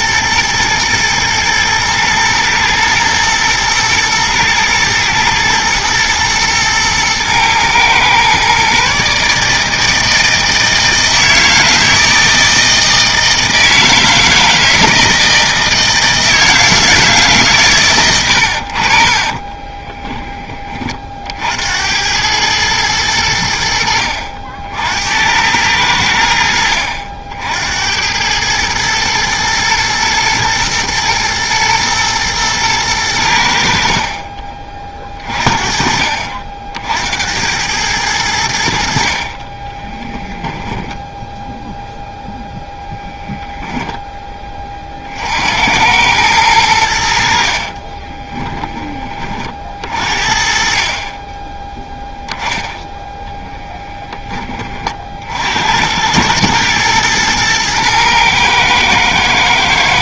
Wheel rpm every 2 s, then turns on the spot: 120, 110, 110, 110, 140, 160, 160, 160, 160, 50, 30, 100, 70, 70, 110, 110, 100, 30, 60, 70, 10, 0, 50, 70, 20, 40, 10, 40, 110, 110.
40-42